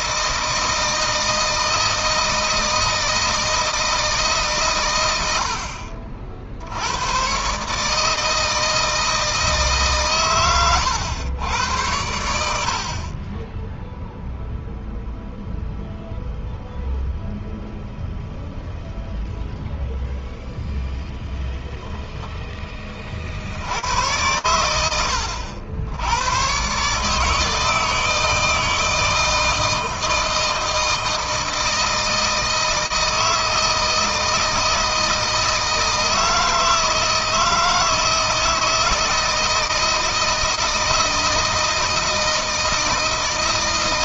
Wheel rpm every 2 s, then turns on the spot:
160, 160, 120, 90, 160, 110, 50, 0, 0, 0, 0, 20, 90, 140, 160, 160, 160, 160, 160, 160, 160, 160.
none